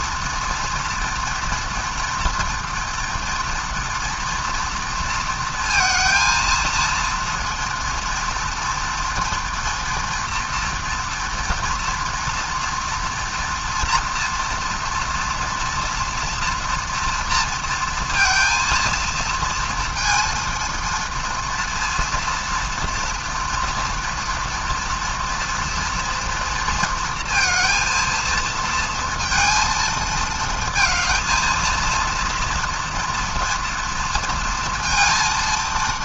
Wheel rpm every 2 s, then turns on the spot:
230, 230, 230, 230, 240, 240, 230, 240, 230, 230, 230, 230, 230, 230, 230, 220, 230, 230.
none